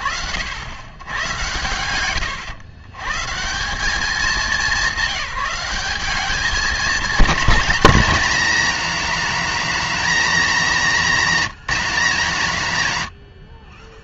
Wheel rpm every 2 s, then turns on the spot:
90, 130, 200, 220, 230, 210, 70.
none